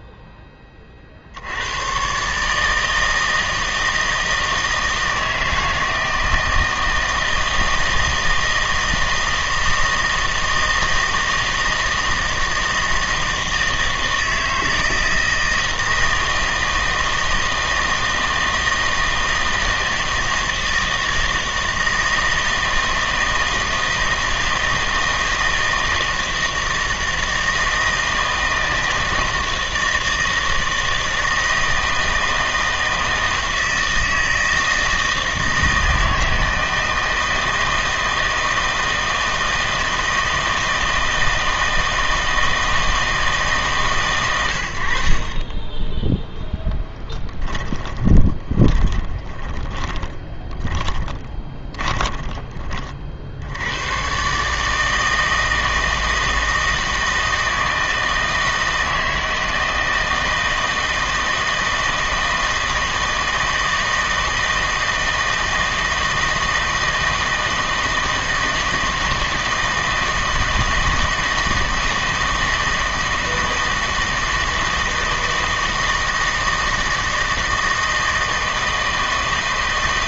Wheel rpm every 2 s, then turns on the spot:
30, 160, 160, 160, 160, 160, 160, 160, 160, 160, 160, 160, 160, 160, 160, 160, 160, 160, 160, 160, 160, 160, 60, 10, 30, 20, 30, 150, 160, 160, 160, 160, 160, 160, 160, 160, 160, 160, 160, 160.
46-52